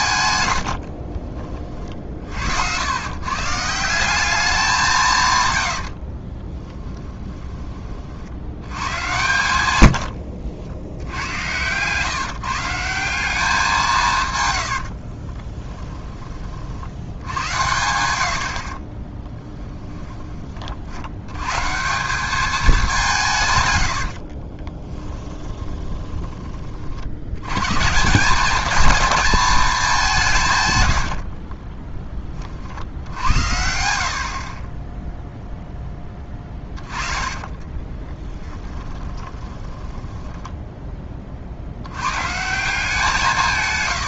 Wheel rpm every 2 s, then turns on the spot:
80, 70, 190, 20, 100, 70, 160, 100, 50, 40, 40, 210, 40, 40, 220, 120, 50, 30, 20, 20, 10, 160.
0-2 6-8 14-16 24-26 36-40